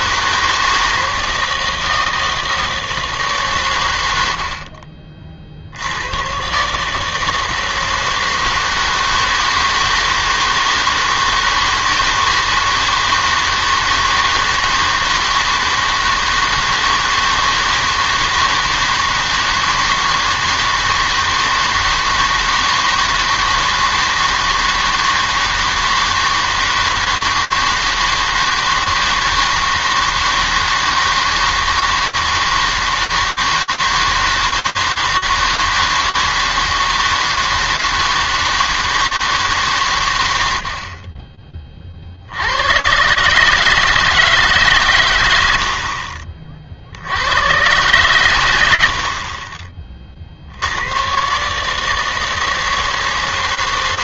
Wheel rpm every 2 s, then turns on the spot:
160, 160, 70, 140, 160, 160, 160, 160, 160, 160, 160, 160, 160, 160, 160, 160, 160, 160, 160, 160, 80, 100, 140, 50, 90, 80, 160.
none